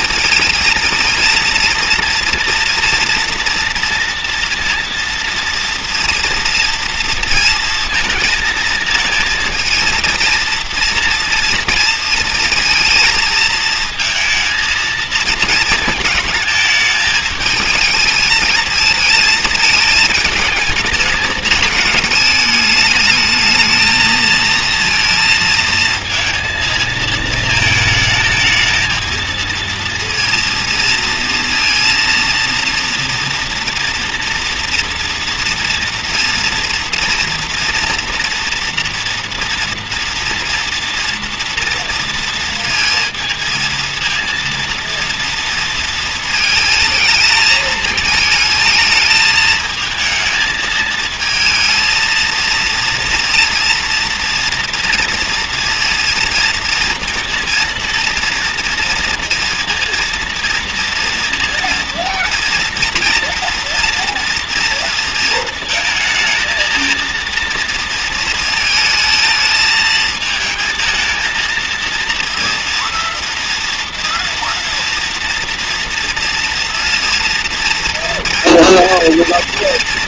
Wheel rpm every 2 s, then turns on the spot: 230, 230, 240, 230, 220, 230, 230, 220, 220, 220, 220, 210, 220, 230, 220, 230, 230, 230, 230, 230, 230, 230, 230, 220, 220, 220, 230, 230, 230, 230, 230, 230, 230, 220, 220, 220, 230, 230, 230, 230.
none